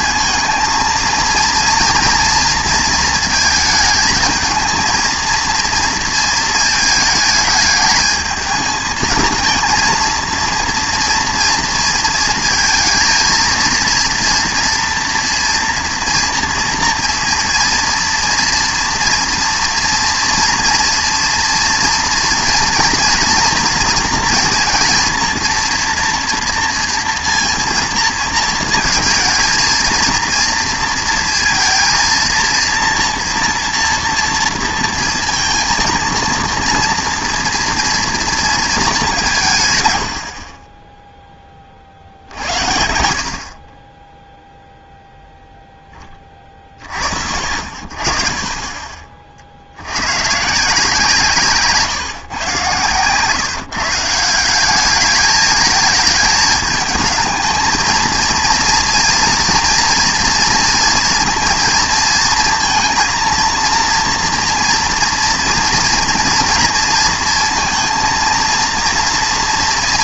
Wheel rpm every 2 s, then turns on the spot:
230, 230, 220, 220, 220, 230, 220, 240, 230, 230, 230, 230, 230, 240, 220, 230, 230, 230, 230, 230, 40, 60, 0, 20, 40, 150, 120, 190, 220, 230, 230, 230, 230, 230, 230.
none